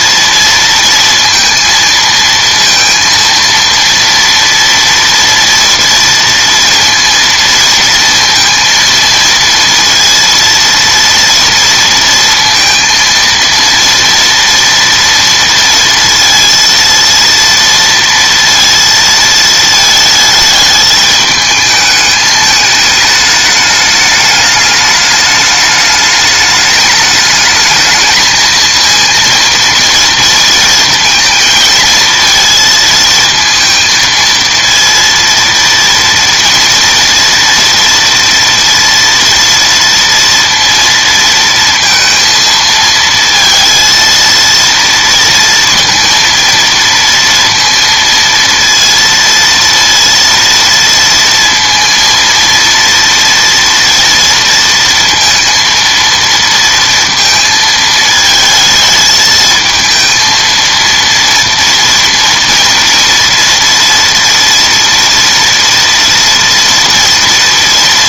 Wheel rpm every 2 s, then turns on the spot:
230, 230, 230, 230, 230, 230, 230, 230, 230, 230, 210, 210, 210, 210, 220, 230, 230, 230, 230, 230, 230, 230, 230, 230, 230, 230, 230, 230, 230, 220, 230, 230, 230, 230.
none